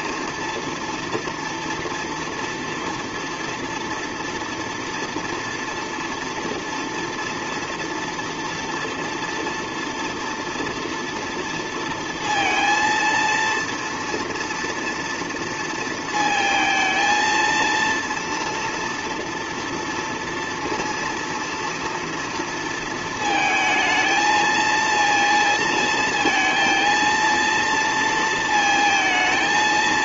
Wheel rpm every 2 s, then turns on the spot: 230, 230, 230, 230, 230, 240, 230, 230, 230, 230, 230, 230, 230, 230, 230.
none